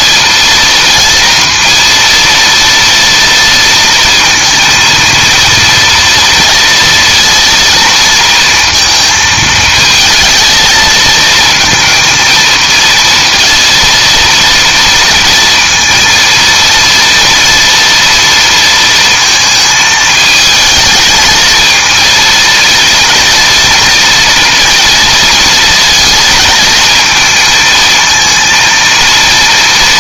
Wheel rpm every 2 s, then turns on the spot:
230, 230, 230, 230, 230, 220, 230, 230, 230, 230, 220, 230, 230, 230, 230.
none